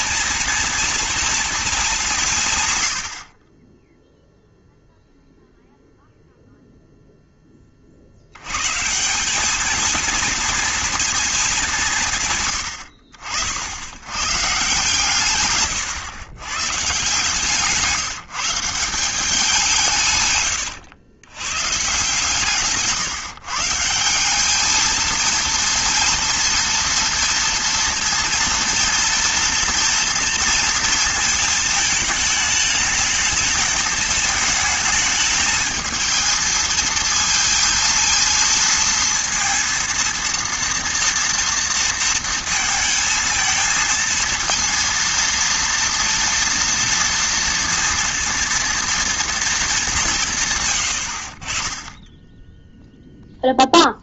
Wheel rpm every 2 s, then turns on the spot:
230, 120, 0, 0, 130, 230, 110, 140, 130, 170, 110, 140, 210, 230, 230, 230, 220, 220, 220, 230, 230, 230, 230, 230, 230, 120, 0.
20-24